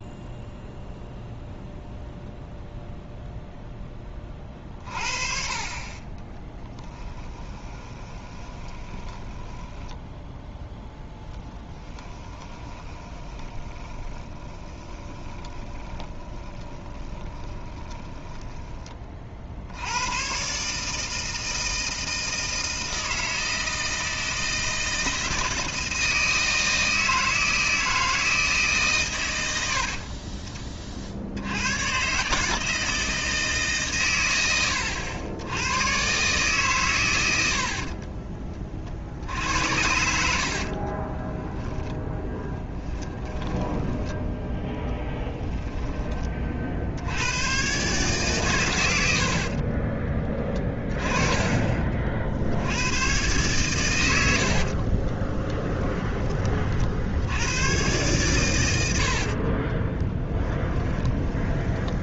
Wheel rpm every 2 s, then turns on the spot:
0, 0, 40, 10, 20, 10, 20, 20, 20, 20, 140, 160, 160, 160, 150, 30, 160, 90, 120, 40, 40, 10, 10, 50, 110, 30, 100, 50, 50, 90, 10.
6-18 40-44 50-52 54-56 60-62